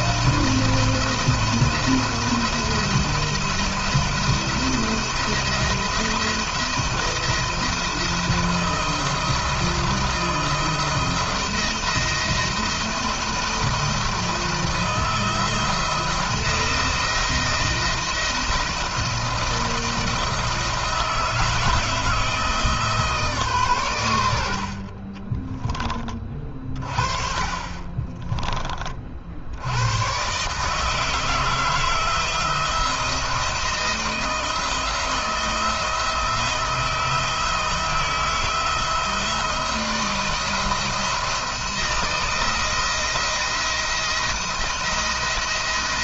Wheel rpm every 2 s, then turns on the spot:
170, 170, 170, 170, 160, 170, 170, 170, 170, 170, 160, 160, 60, 30, 30, 150, 170, 170, 160, 160, 160, 170, 170.
24-26